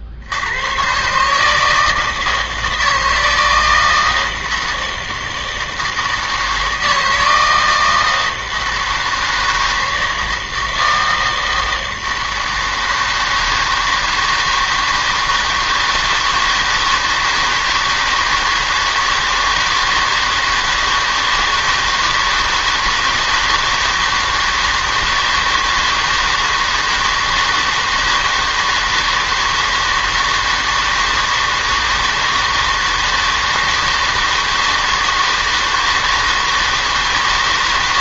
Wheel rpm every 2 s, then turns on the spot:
110, 160, 160, 160, 160, 160, 160, 160, 160, 160, 160, 160, 160, 160, 160, 160, 160, 160, 160.
none